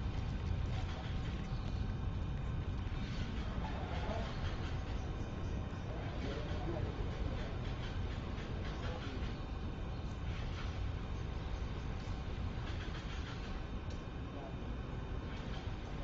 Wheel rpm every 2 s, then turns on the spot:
0, 0, 0, 0, 0, 0, 0, 0.
none